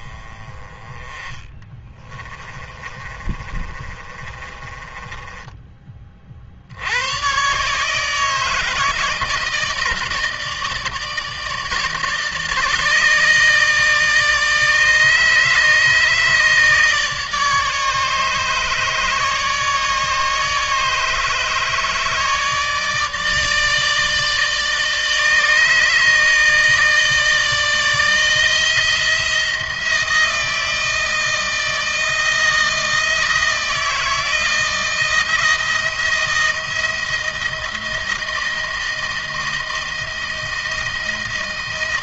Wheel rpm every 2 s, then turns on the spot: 20, 30, 20, 90, 160, 160, 150, 150, 150, 150, 150, 150, 150, 160, 160, 170, 170, 170, 170, 160, 160.
2-6